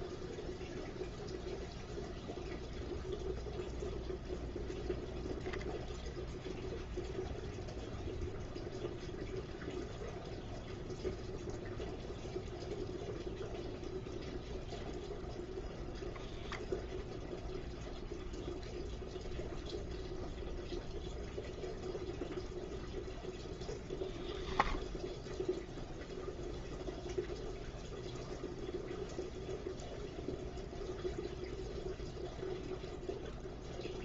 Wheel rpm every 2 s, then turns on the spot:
0, 0, 0, 0, 0, 0, 0, 0, 0, 0, 0, 0, 0, 0, 0, 0, 0.
none